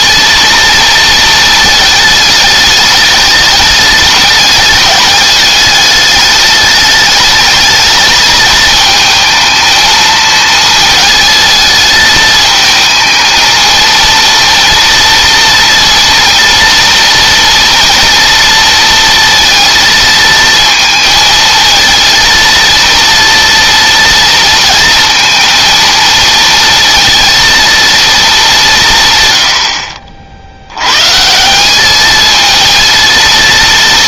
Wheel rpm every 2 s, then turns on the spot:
230, 210, 210, 210, 220, 220, 220, 230, 230, 230, 220, 230, 230, 230, 150, 120, 230.
none